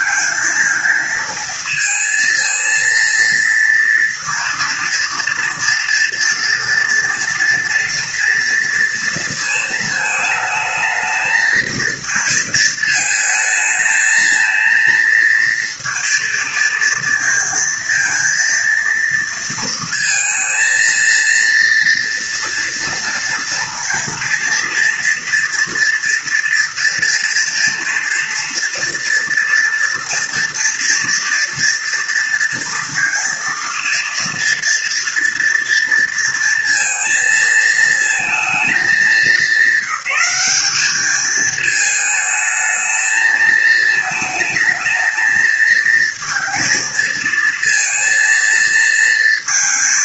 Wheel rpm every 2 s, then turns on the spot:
220, 230, 230, 230, 230, 220, 220, 230, 230, 230, 230, 240, 230, 230, 230, 230, 230, 230, 230, 220, 210, 220, 220, 220, 230.
none